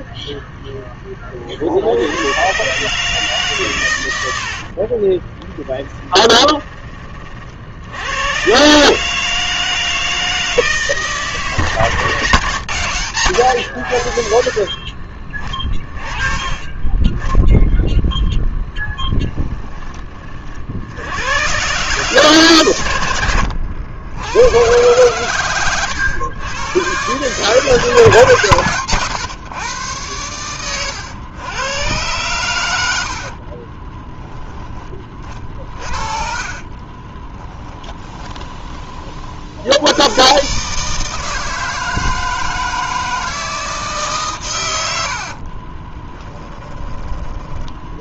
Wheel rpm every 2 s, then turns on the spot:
20, 140, 30, 30, 150, 160, 120, 40, 20, 10, 80, 100, 100, 120, 130, 110, 80, 30, 30, 30, 150, 160, 90, 20.
4-6 18-20 32-34 36-38